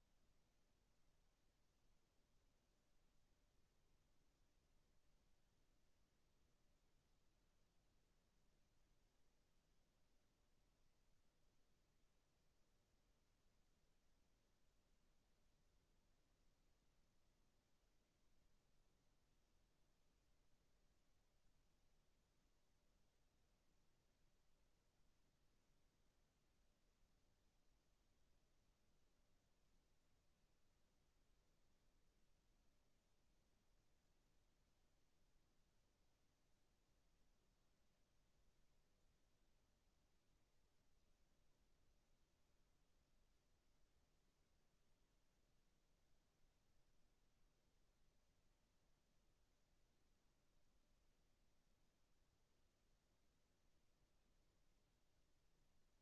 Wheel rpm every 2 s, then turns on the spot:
0, 0, 0, 0, 0, 0, 0, 0, 0, 0, 0, 0, 0, 0, 0, 0, 0, 0, 0, 0, 0, 0, 0, 0, 0, 0, 0, 0.
none